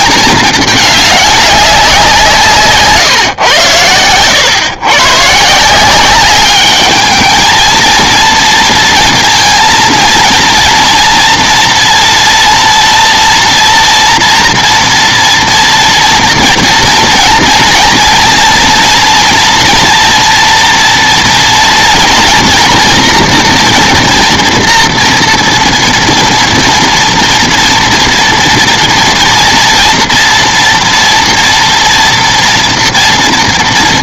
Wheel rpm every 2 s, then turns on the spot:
210, 150, 110, 200, 230, 230, 230, 240, 230, 230, 230, 230, 230, 230, 230, 230, 230.
none